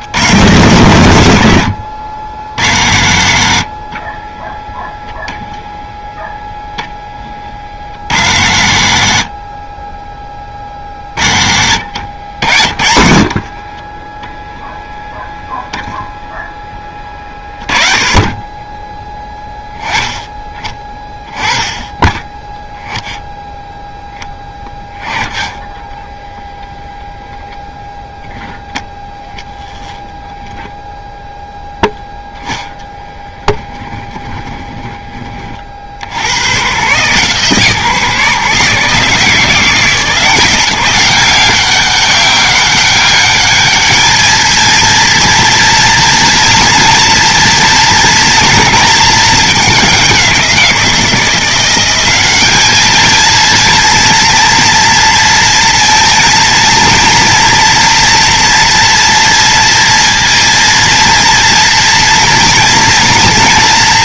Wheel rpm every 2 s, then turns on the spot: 120, 80, 10, 10, 100, 30, 70, 10, 20, 10, 20, 10, 10, 0, 0, 0, 10, 10, 120, 150, 180, 200, 230, 230, 230, 170, 210, 230, 230, 240, 230, 230.
12-14 32-36